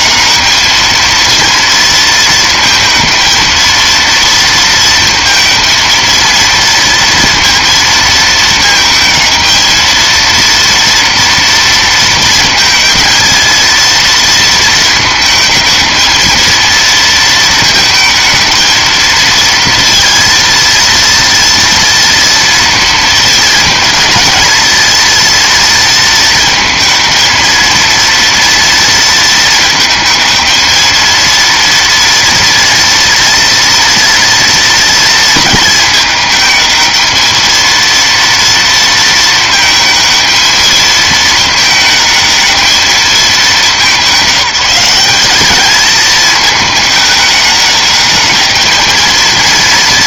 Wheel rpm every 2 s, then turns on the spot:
230, 220, 220, 230, 220, 230, 230, 220, 230, 220, 230, 230, 230, 220, 230, 230, 240, 230, 220, 230, 220, 220, 200, 210, 220.
none